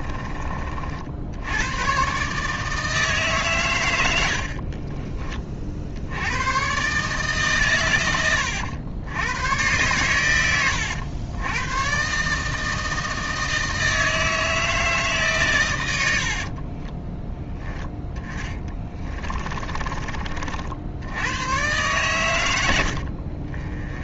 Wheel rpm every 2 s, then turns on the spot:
40, 150, 30, 130, 90, 90, 160, 150, 20, 20, 70, 80.
4-6 18-20